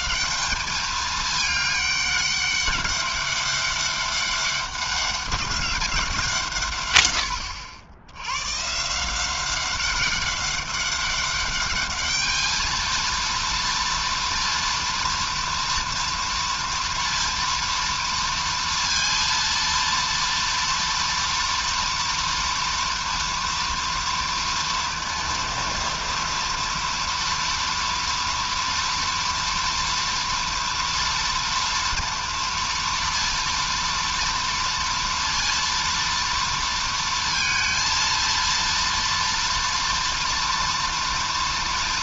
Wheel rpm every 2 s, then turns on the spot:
180, 200, 200, 160, 120, 200, 220, 230, 230, 230, 230, 230, 230, 230, 230, 230, 230, 230, 230, 230, 230.
none